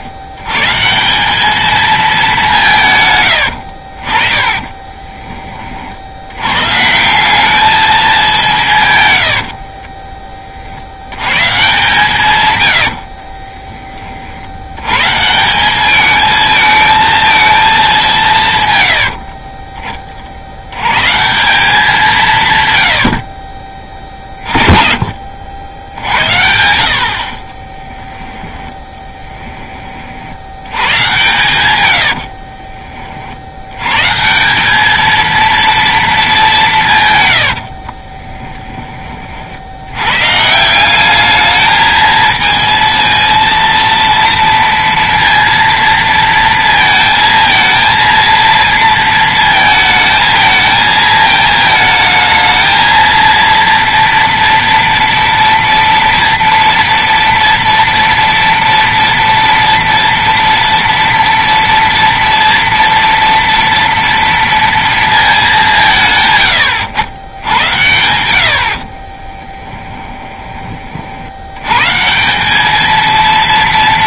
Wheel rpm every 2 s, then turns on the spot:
130, 180, 30, 130, 170, 50, 100, 90, 220, 130, 80, 130, 30, 70, 10, 90, 50, 190, 190, 10, 170, 230, 230, 230, 230, 220, 220, 230, 230, 230, 230, 230, 230, 110, 70, 30, 200.
4-6 12-14 32-34